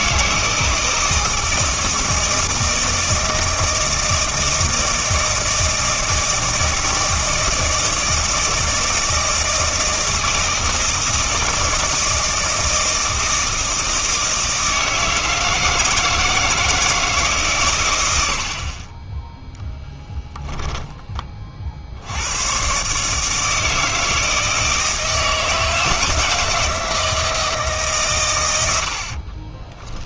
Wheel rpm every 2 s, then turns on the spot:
160, 160, 160, 160, 160, 160, 160, 160, 160, 40, 10, 120, 160, 160, 90.
none